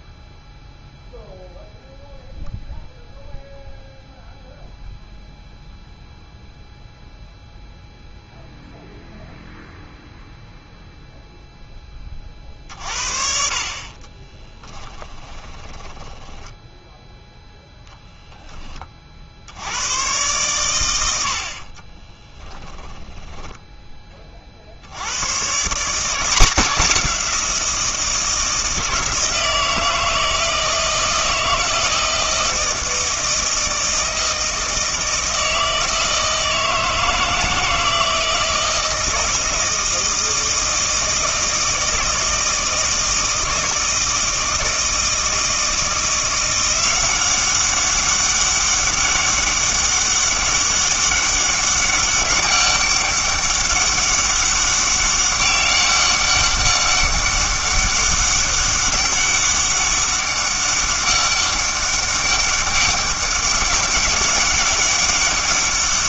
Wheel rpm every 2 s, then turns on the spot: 0, 0, 0, 0, 0, 0, 40, 10, 10, 20, 100, 10, 70, 180, 160, 160, 160, 160, 160, 160, 160, 160, 160, 180, 200, 200, 200, 200, 200, 200, 200, 200, 200.
14-18 22-24